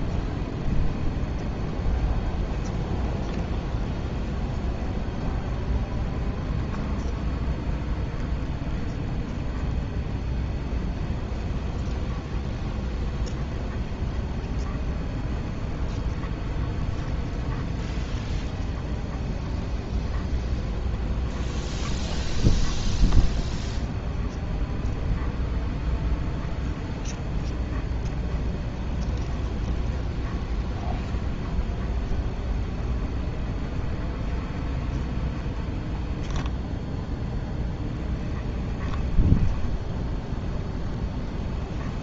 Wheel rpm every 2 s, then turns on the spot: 20, 20, 20, 20, 20, 20, 20, 20, 20, 20, 20, 20, 20, 20, 20, 20, 20, 20, 10, 10, 0.
0-38